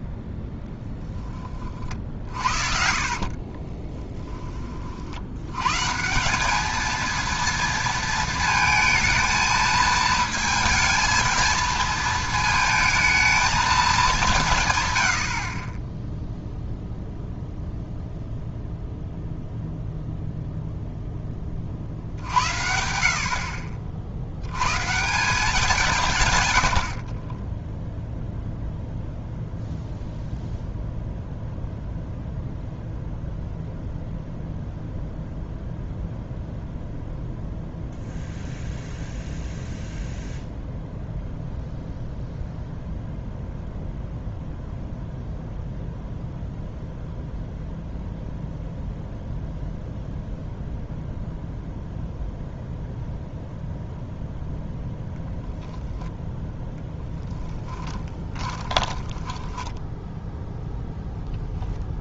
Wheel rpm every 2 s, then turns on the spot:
10, 50, 40, 210, 220, 220, 220, 120, 0, 0, 0, 70, 120, 80, 0, 0, 0, 0, 0, 0, 0, 0, 0, 0, 0, 0, 0, 0, 0, 20, 0.
2-4 58-60